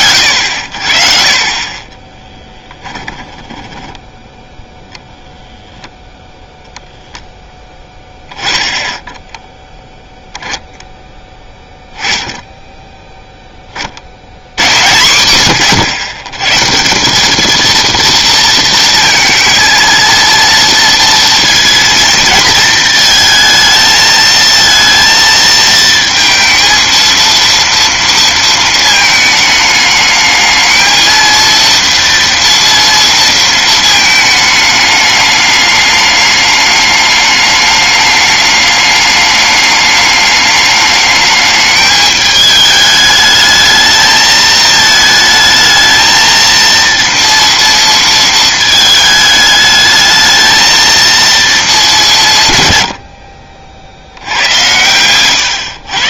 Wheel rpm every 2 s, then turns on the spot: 80, 20, 0, 0, 10, 0, 10, 90, 130, 230, 230, 230, 230, 230, 220, 220, 230, 220, 210, 210, 210, 210, 220, 230, 220, 220, 140, 90.
2-4